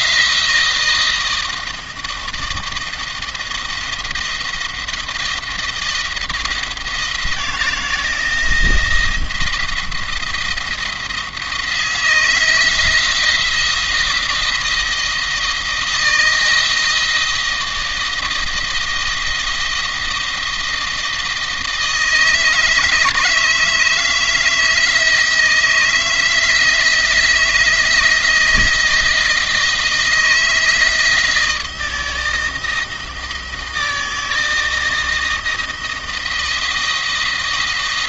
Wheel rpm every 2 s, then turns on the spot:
160, 170, 170, 170, 170, 170, 160, 170, 160, 160, 160, 160, 160, 160, 160, 160, 160, 160, 160.
none